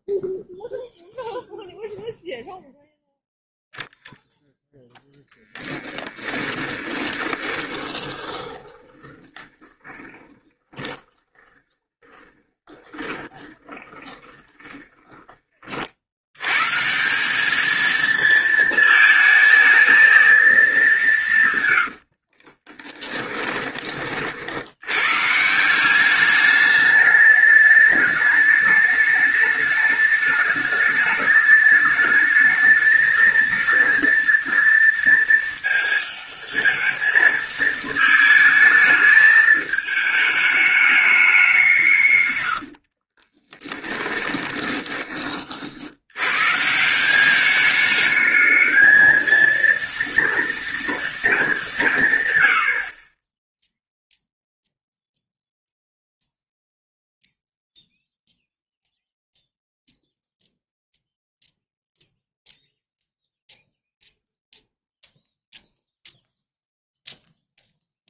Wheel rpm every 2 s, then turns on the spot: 0, 0, 0, 20, 20, 20, 20, 10, 160, 220, 180, 10, 100, 210, 210, 210, 220, 230, 230, 220, 210, 40, 20, 180, 220, 230, 50, 0, 0, 0, 0, 0, 0, 0.
6-16 22-24 42-44